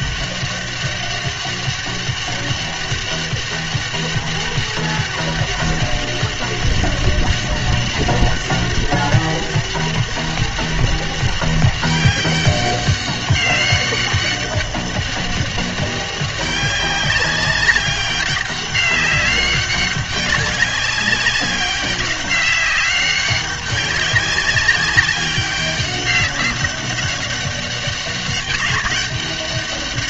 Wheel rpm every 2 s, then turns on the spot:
200, 200, 200, 200, 200, 200, 200, 200, 200, 190, 200, 190, 200, 200, 200.
none